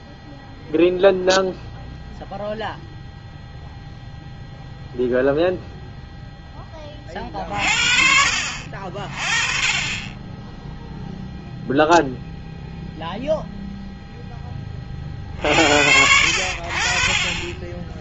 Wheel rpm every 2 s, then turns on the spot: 0, 0, 0, 10, 50, 10, 0, 20, 60.
none